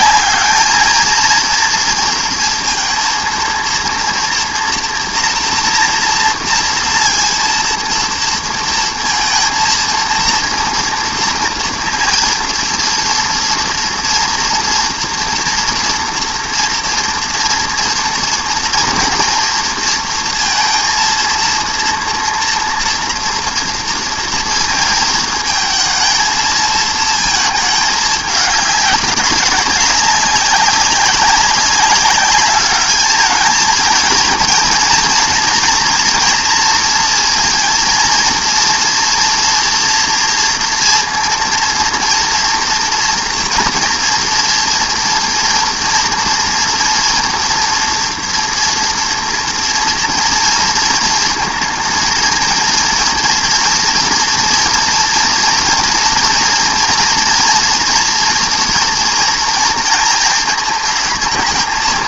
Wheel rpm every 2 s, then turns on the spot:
220, 230, 240, 230, 230, 230, 230, 240, 230, 230, 230, 230, 230, 220, 200, 200, 210, 230, 230, 230, 230, 230, 240, 230, 230, 230, 230, 240, 230, 240, 220.
none